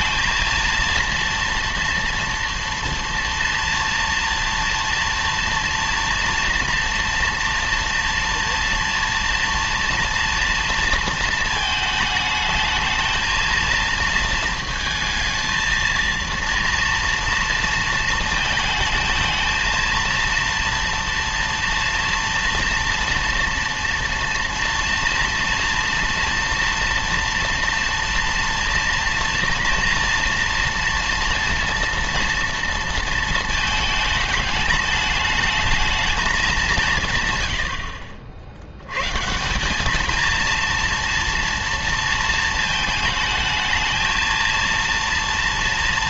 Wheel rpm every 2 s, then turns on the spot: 230, 230, 230, 230, 230, 230, 220, 220, 230, 220, 230, 230, 230, 230, 230, 230, 230, 210, 190, 90, 230, 220, 230.
none